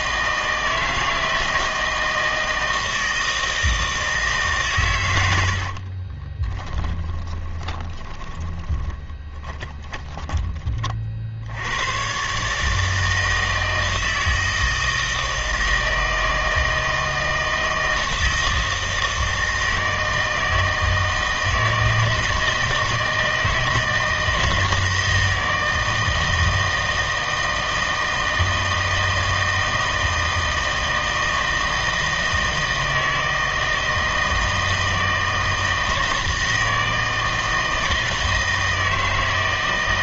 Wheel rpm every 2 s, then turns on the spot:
160, 160, 130, 10, 10, 30, 150, 160, 160, 160, 160, 160, 160, 160, 160, 160, 160, 160, 160, 160.
6-10